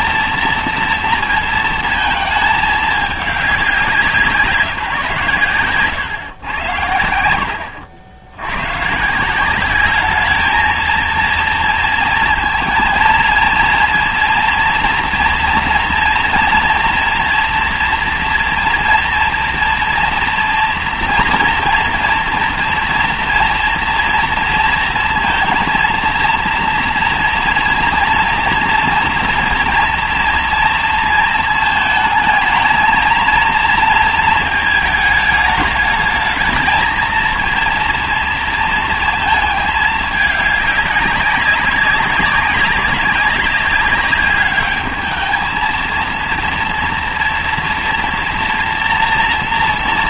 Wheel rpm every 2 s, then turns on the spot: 230, 220, 150, 100, 120, 220, 230, 230, 230, 240, 230, 230, 230, 230, 230, 240, 220, 220, 220, 230, 200, 200, 210, 230, 230.
none